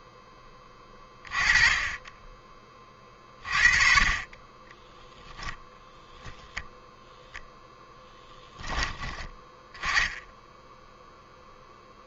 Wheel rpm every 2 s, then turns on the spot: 20, 30, 10, 0, 10, 10.
4-6